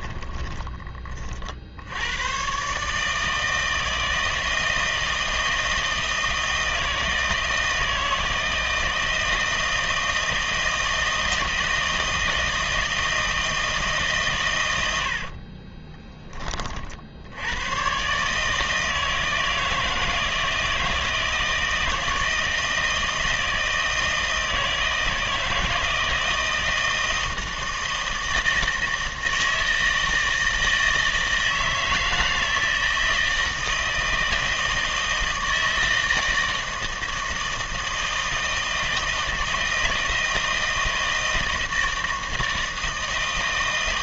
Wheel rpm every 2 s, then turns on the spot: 30, 130, 160, 160, 160, 160, 160, 100, 40, 160, 160, 160, 160, 160, 160, 160, 160, 160, 160, 160, 160, 160.
0-2